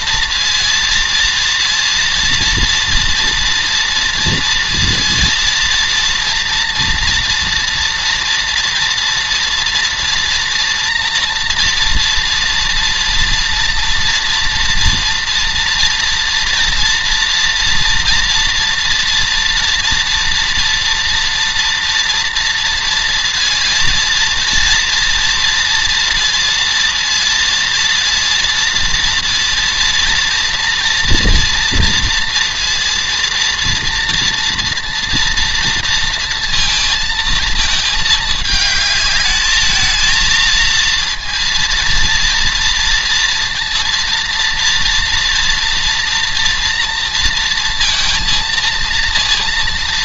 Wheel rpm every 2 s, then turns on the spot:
230, 230, 230, 230, 240, 230, 230, 230, 230, 230, 230, 230, 230, 230, 230, 230, 230, 230, 230, 220, 230, 230, 230, 230, 230.
none